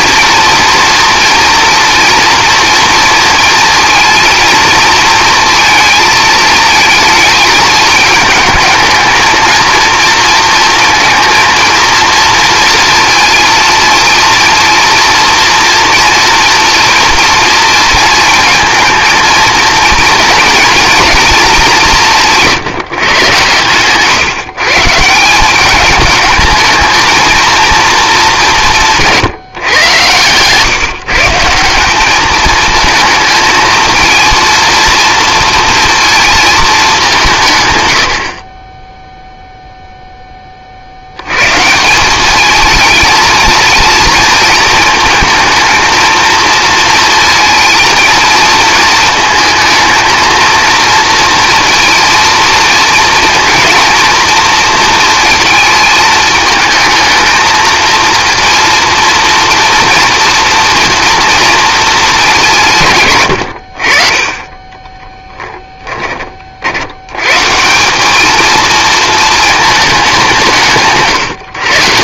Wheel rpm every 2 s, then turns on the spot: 230, 230, 230, 220, 220, 230, 230, 230, 230, 230, 230, 150, 160, 220, 170, 140, 220, 230, 190, 10, 70, 220, 230, 230, 220, 230, 230, 230, 220, 230, 230, 120, 10, 80, 230, 150.
64-66